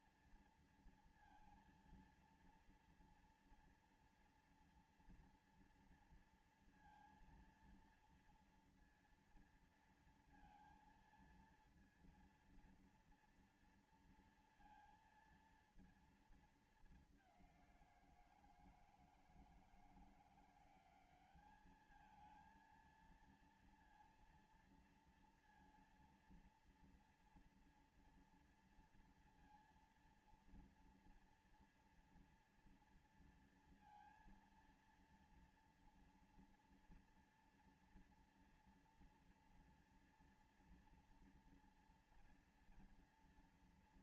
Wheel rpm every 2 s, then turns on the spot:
230, 230, 230, 230, 230, 230, 230, 230, 230, 190, 160, 200, 230, 230, 230, 230, 230, 230, 230, 230, 240, 240.
none